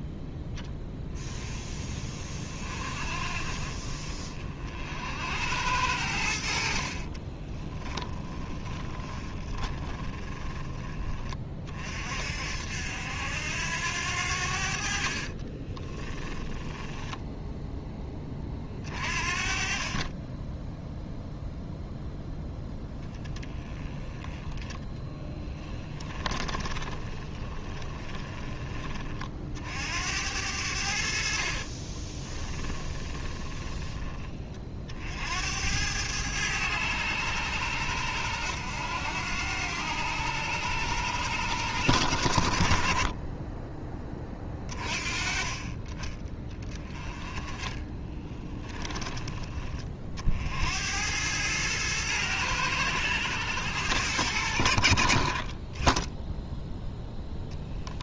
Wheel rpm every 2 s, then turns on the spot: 10, 30, 50, 60, 20, 20, 70, 60, 10, 40, 10, 0, 10, 20, 20, 80, 20, 50, 100, 90, 100, 60, 30, 20, 20, 70, 100, 70, 0.
8-10 16-18 26-28 32-34 46-50